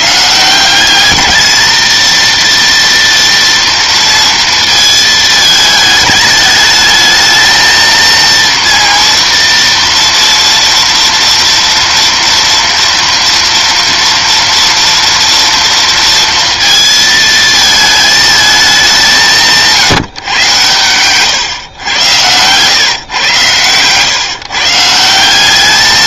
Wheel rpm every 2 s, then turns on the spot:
180, 230, 230, 210, 230, 230, 230, 230, 230, 200, 120, 120, 150.
none